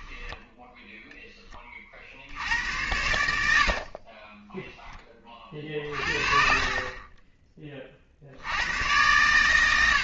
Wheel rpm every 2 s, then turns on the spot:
0, 80, 10, 40, 110.
2-4